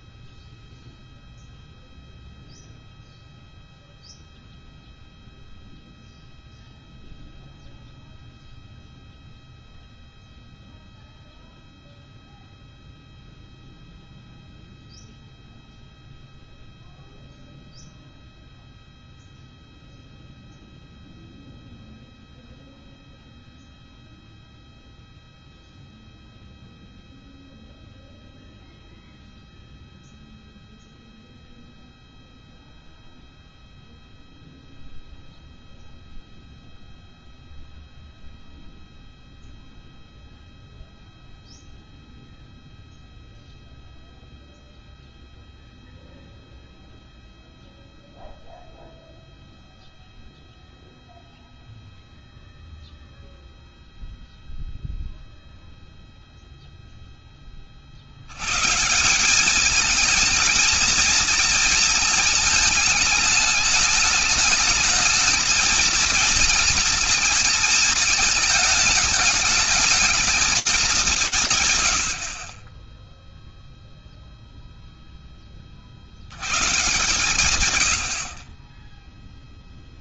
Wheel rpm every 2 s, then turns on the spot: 0, 0, 0, 0, 0, 0, 0, 0, 0, 0, 0, 0, 0, 0, 0, 0, 0, 0, 0, 0, 0, 0, 0, 0, 0, 0, 0, 0, 0, 140, 230, 220, 220, 230, 220, 200, 10, 0, 140, 30.
none